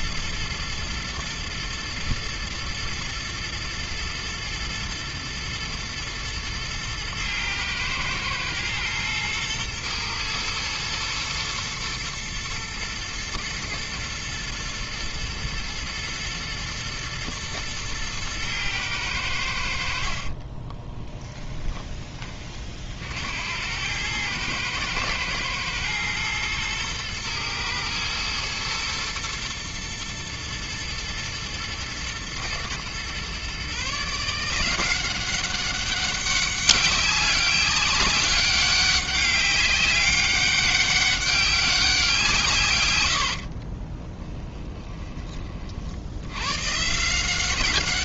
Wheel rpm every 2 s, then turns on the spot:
110, 110, 110, 110, 120, 110, 110, 110, 110, 100, 20, 60, 110, 110, 120, 110, 120, 180, 200, 200, 200, 110, 10, 140.
20-22 44-46